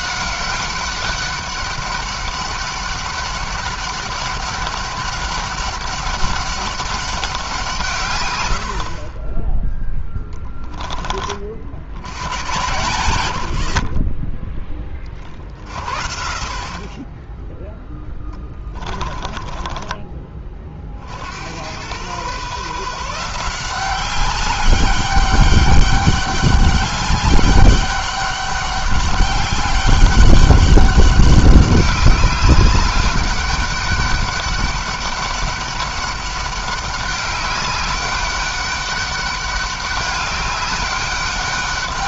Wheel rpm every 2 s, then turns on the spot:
200, 200, 200, 200, 50, 20, 110, 20, 20, 20, 50, 160, 200, 200, 200, 200, 200, 200, 200, 200, 200.
18-20